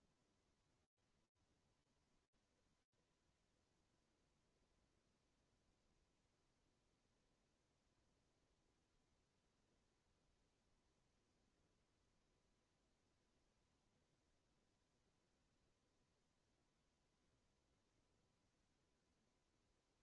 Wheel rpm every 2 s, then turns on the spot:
0, 0, 0, 0, 0, 0, 0, 0, 0, 0.
none